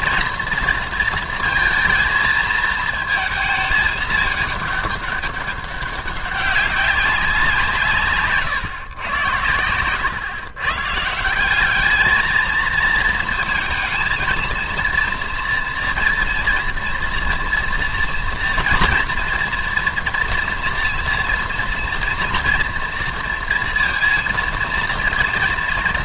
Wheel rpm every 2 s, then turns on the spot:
230, 220, 210, 190, 140, 130, 230, 230, 230, 230, 230, 230, 230.
none